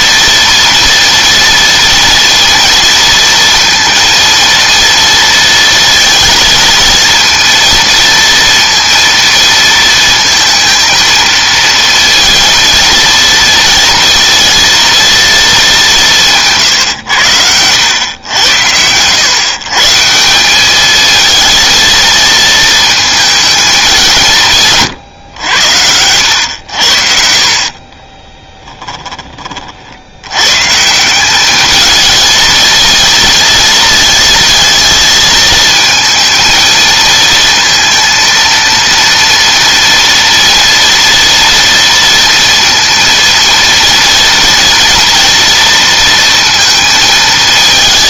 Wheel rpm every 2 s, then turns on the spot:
230, 230, 230, 230, 230, 220, 230, 230, 130, 100, 210, 230, 140, 70, 10, 140, 230, 230, 230, 230, 230, 230, 240, 230.
28-30